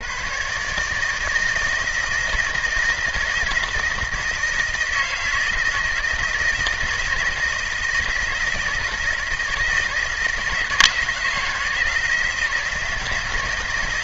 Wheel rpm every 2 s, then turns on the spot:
140, 160, 160, 160, 160, 160, 160.
none